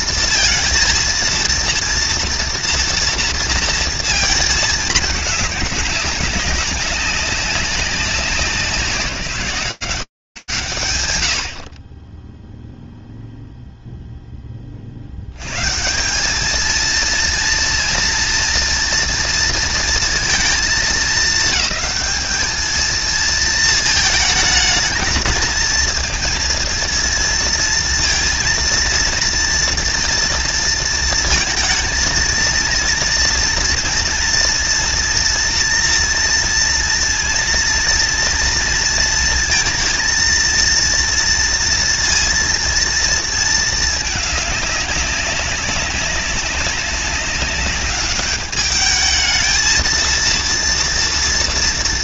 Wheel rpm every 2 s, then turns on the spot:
230, 230, 220, 190, 190, 90, 0, 40, 220, 230, 220, 220, 220, 230, 230, 230, 230, 230, 230, 230, 230, 230, 200, 200, 220, 230.
none